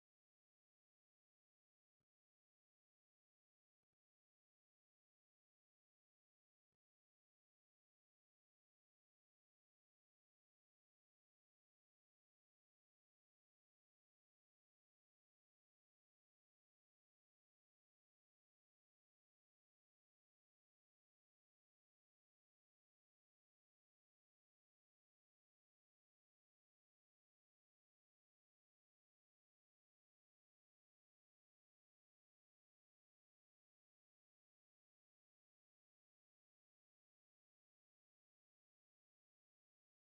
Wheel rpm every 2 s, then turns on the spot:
0, 0, 0, 0, 0, 0, 0, 0, 0, 0, 0, 0, 0, 0, 0, 0, 0, 0, 0, 0.
none